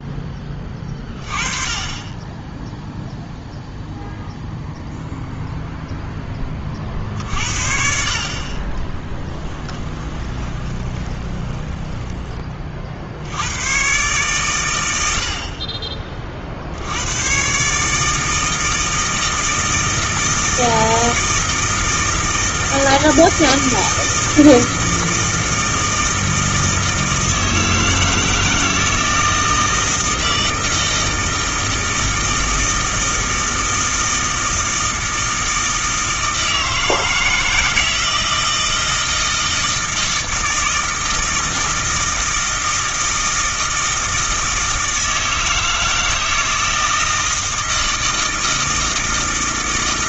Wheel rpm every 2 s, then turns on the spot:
30, 0, 0, 30, 20, 20, 40, 100, 70, 160, 160, 160, 160, 160, 160, 160, 160, 160, 160, 160, 160, 160, 160, 160, 160.
10-12